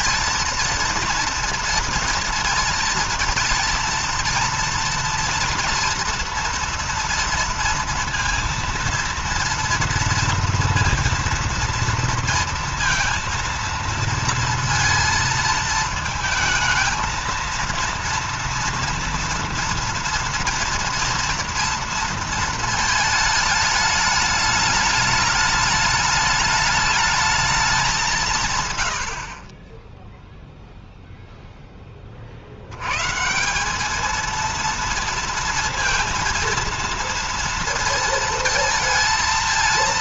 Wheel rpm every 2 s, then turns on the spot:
230, 230, 230, 230, 230, 230, 230, 230, 220, 230, 230, 230, 210, 210, 140, 0, 70, 230, 230, 230.
none